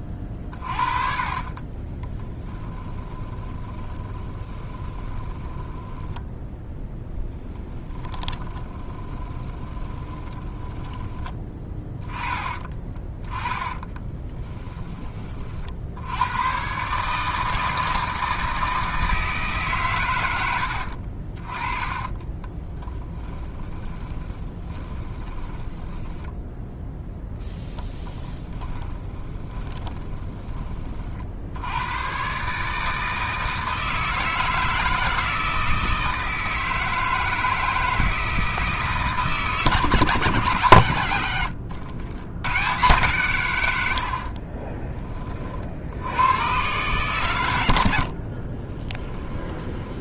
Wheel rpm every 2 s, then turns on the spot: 30, 30, 20, 10, 20, 10, 10, 10, 120, 160, 80, 10, 20, 0, 10, 20, 140, 160, 160, 160, 130, 100, 30, 120, 30.
0-6 8-12 14-16 20-26 28-30 44-46 48-50